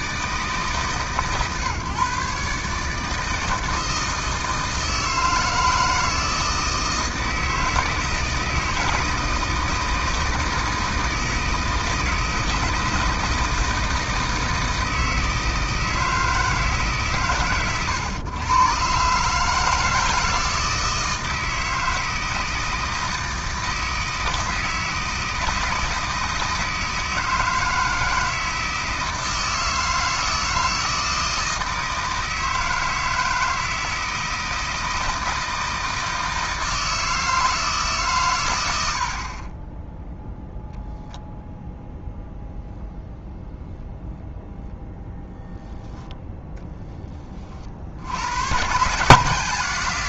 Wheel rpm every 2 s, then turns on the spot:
150, 150, 160, 160, 160, 160, 160, 160, 150, 120, 160, 160, 160, 160, 160, 160, 160, 160, 160, 90, 0, 0, 0, 20, 130.
none